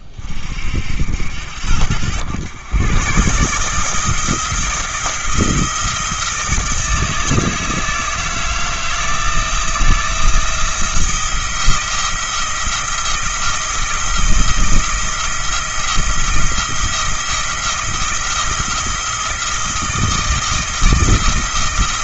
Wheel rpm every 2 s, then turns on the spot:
60, 120, 170, 160, 160, 170, 170, 170, 170, 170, 160.
none